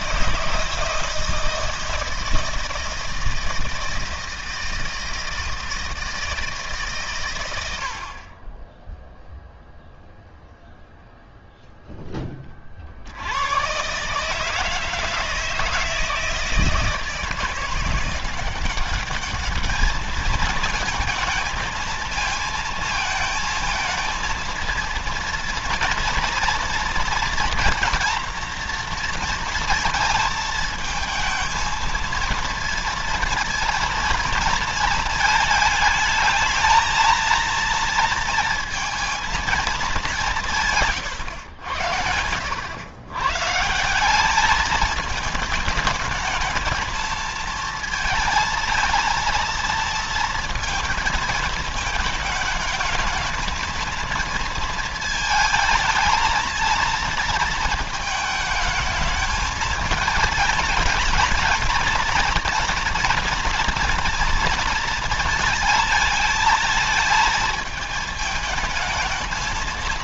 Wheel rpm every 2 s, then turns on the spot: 150, 160, 160, 150, 20, 0, 30, 150, 160, 180, 220, 220, 230, 240, 230, 220, 230, 220, 220, 230, 130, 90, 210, 220, 230, 220, 220, 230, 230, 220, 220, 230, 230, 220, 220.
none